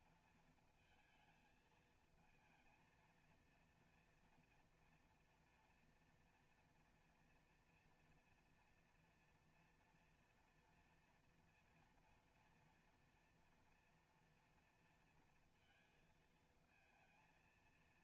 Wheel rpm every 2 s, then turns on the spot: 230, 220, 230, 230, 230, 230, 240, 230, 220.
none